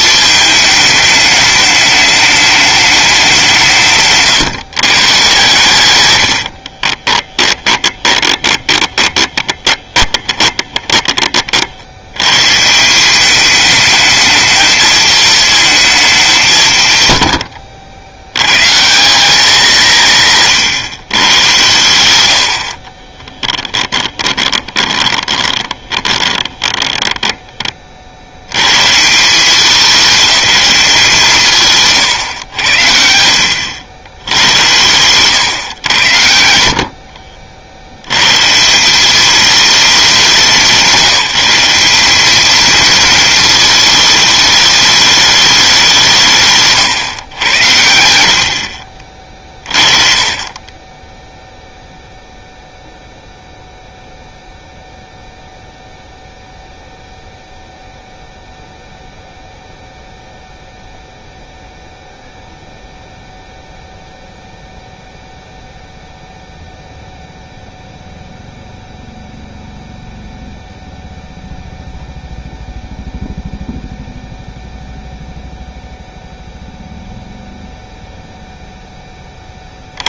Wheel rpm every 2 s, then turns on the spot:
210, 200, 130, 30, 20, 20, 170, 220, 130, 180, 130, 30, 10, 20, 120, 190, 80, 110, 60, 180, 190, 220, 210, 130, 50, 20, 0, 0, 0, 0, 0, 0, 0, 0, 0, 0, 0, 0, 0, 0.
6-12 22-28 50-52